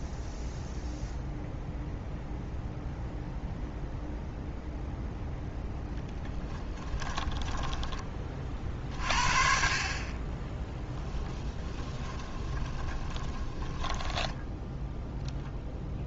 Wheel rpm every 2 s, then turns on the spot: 0, 0, 0, 20, 50, 10, 20, 0.
6-8 10-14